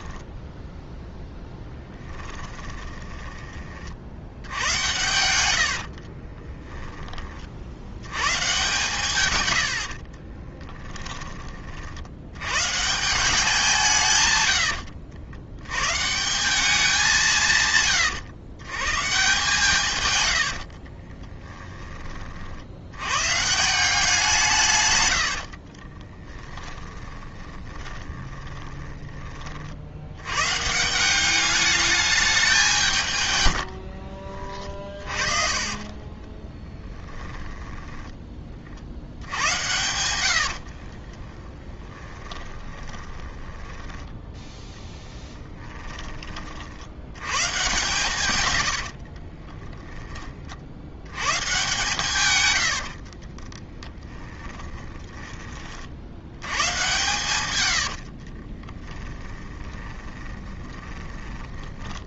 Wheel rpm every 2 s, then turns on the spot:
0, 10, 90, 10, 140, 10, 150, 90, 200, 130, 60, 80, 150, 10, 10, 150, 180, 40, 10, 40, 60, 20, 20, 60, 90, 60, 90, 10, 120, 20, 20.
2-4 6-8 10-12 20-22 26-30 34-38 40-46 48-50 52-56 58-62